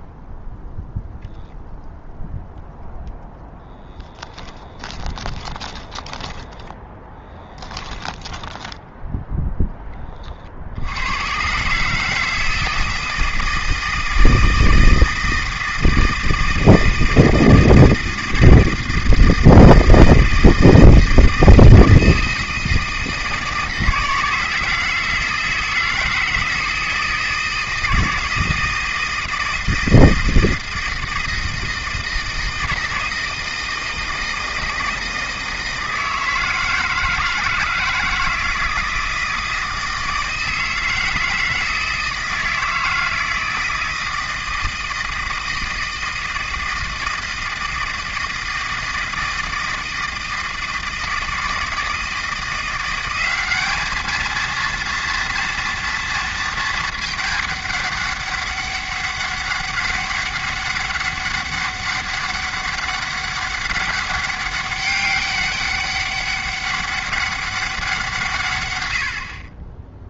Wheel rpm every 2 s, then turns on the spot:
0, 0, 20, 10, 10, 70, 160, 160, 160, 160, 160, 160, 160, 160, 160, 160, 160, 160, 160, 160, 160, 160, 160, 160, 160, 160, 180, 230, 220, 200, 200, 200, 200, 200, 110.
4-10